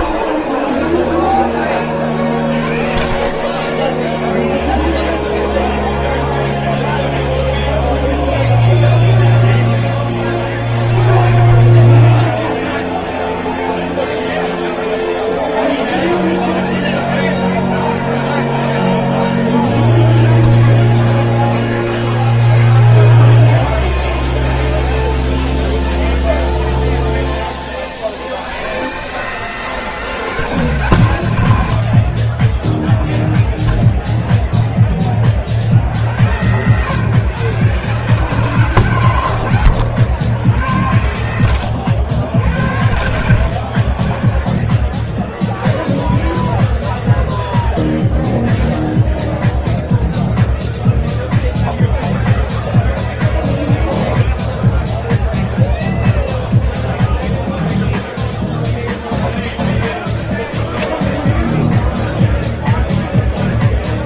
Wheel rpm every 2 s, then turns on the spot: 10, 40, 0, 0, 0, 20, 0, 0, 0, 0, 0, 40, 40, 0, 110, 120, 10, 10, 120, 130, 90, 80, 10, 0, 0, 0, 0, 0, 0, 0, 0, 0.
22-26 44-46